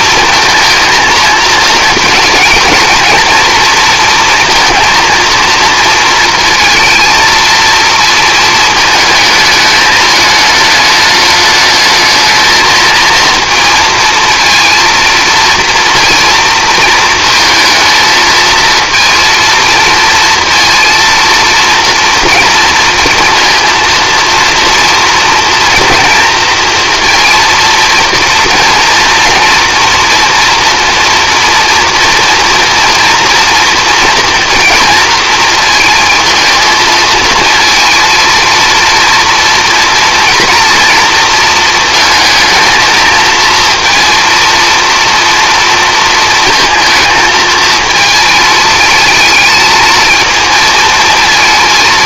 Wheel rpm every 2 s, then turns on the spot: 230, 230, 230, 230, 220, 210, 230, 230, 220, 220, 230, 230, 230, 230, 240, 230, 230, 240, 220, 230, 230, 220, 230, 230, 220, 230.
none